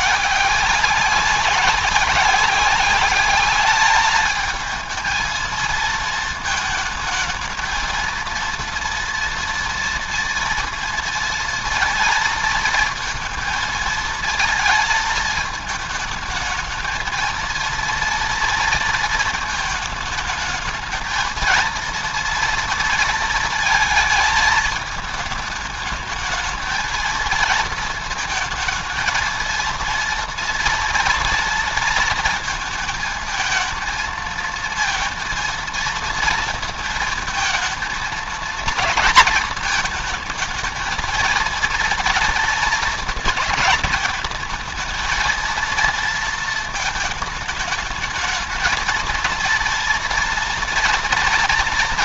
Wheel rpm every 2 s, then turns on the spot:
190, 200, 220, 220, 230, 230, 220, 220, 220, 230, 220, 230, 220, 220, 220, 240, 220, 230, 220, 230, 230, 220, 220, 220, 230, 230.
none